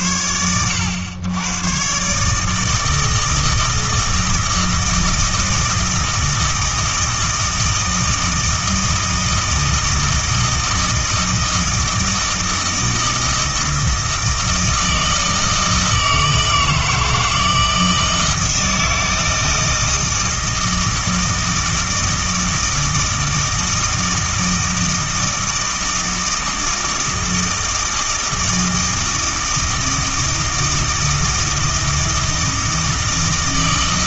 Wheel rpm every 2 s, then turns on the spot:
100, 160, 160, 160, 160, 160, 160, 160, 160, 160, 160, 160, 160, 160, 160, 160, 160.
none